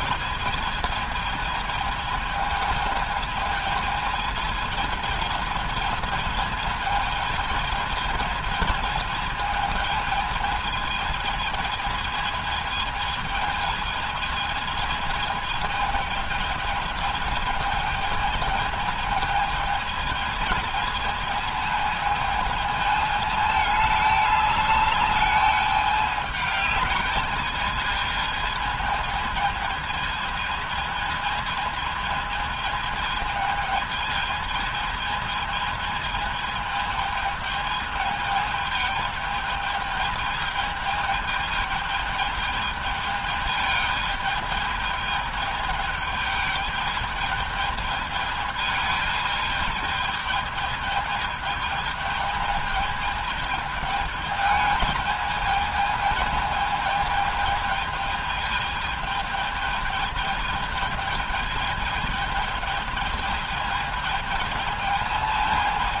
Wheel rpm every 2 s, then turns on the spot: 220, 220, 220, 220, 220, 220, 220, 220, 220, 220, 220, 220, 210, 210, 220, 220, 220, 220, 220, 220, 220, 220, 210, 210, 220, 220, 220, 210, 220, 210, 210, 220, 220.
none